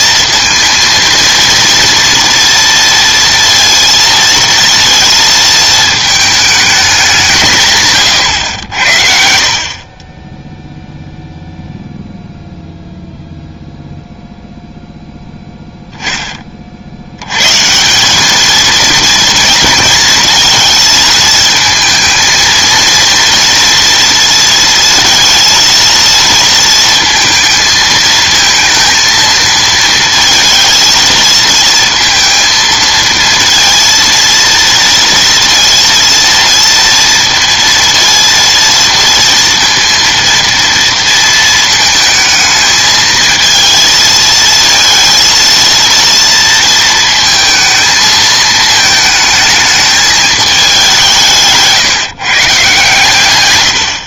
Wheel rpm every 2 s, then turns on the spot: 230, 230, 230, 220, 90, 10, 0, 0, 40, 220, 220, 230, 230, 230, 230, 230, 230, 230, 230, 230, 230, 220, 220, 230, 220, 210, 140.
none